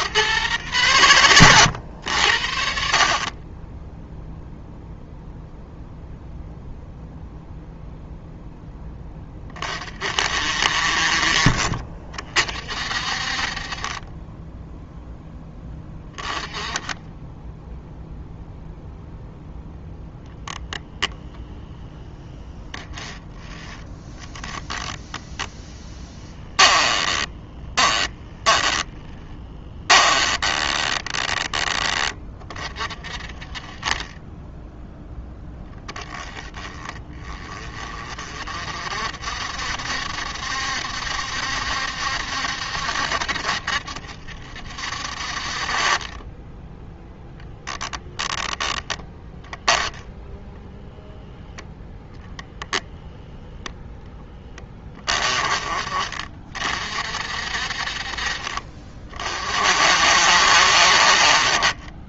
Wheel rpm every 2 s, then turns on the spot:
110, 40, 0, 0, 10, 50, 50, 0, 10, 0, 0, 10, 10, 10, 10, 10, 40, 0, 20, 60, 70, 70, 60, 0, 10, 0, 0, 20, 50, 40, 50.
26-32